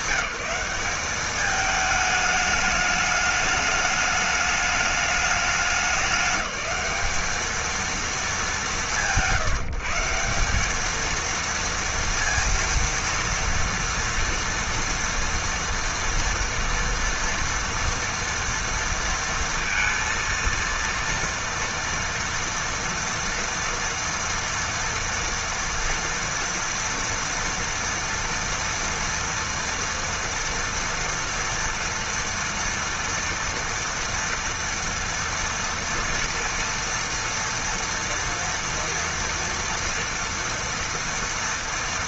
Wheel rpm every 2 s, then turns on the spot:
190, 210, 210, 200, 190, 210, 230, 230, 230, 230, 230, 230, 240, 230, 230, 230, 230, 230, 230, 230, 240.
none